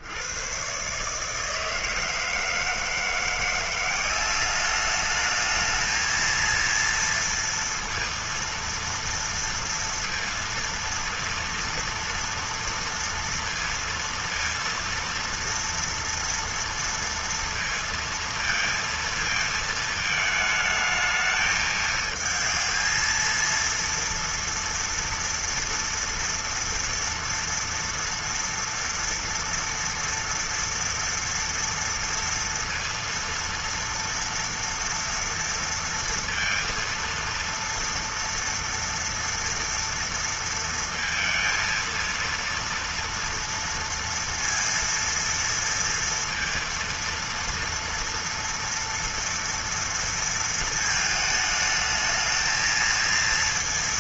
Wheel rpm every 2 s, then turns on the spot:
70, 160, 190, 230, 230, 230, 230, 230, 230, 230, 220, 220, 230, 230, 240, 230, 230, 230, 230, 230, 230, 230, 230, 230, 230, 230, 220.
none